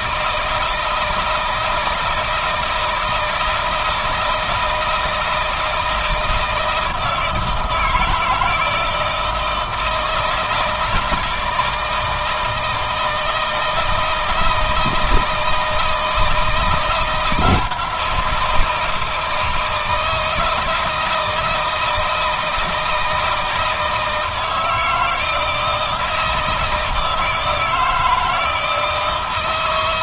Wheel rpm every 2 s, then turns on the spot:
160, 160, 160, 160, 160, 160, 160, 160, 170, 160, 160, 160, 160, 160, 160.
none